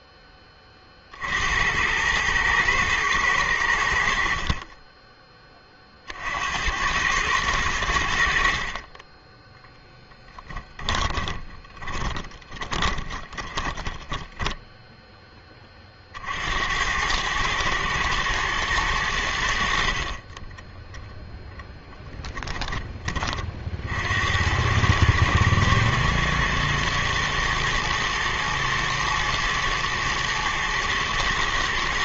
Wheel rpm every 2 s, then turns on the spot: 80, 90, 20, 110, 10, 20, 10, 20, 100, 70, 0, 30, 110, 110, 110, 120.
10-14